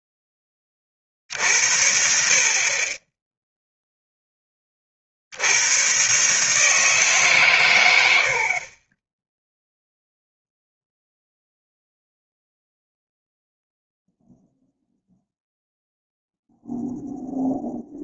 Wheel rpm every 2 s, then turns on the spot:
20, 60, 20, 150, 50, 0, 0, 0, 0.
none